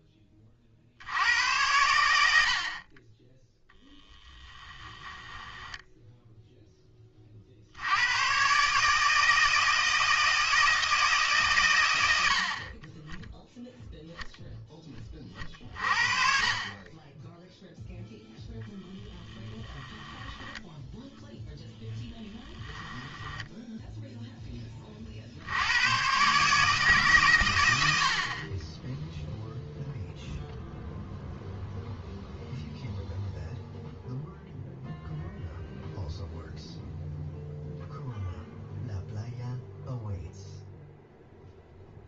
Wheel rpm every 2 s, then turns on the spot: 60, 40, 10, 10, 140, 160, 40, 10, 30, 0, 0, 10, 30, 150, 10, 0, 0, 0, 0, 0, 0.
4-6 22-24